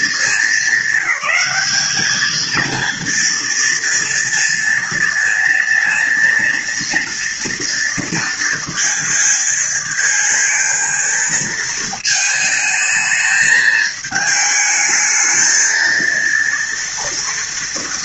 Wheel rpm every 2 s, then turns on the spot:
210, 220, 240, 230, 230, 230, 220, 210, 230.
none